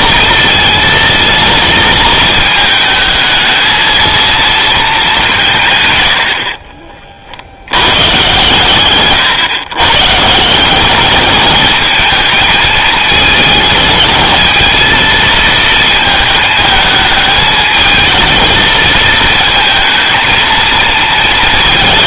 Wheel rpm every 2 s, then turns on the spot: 220, 220, 220, 40, 130, 180, 210, 220, 220, 220, 230.
none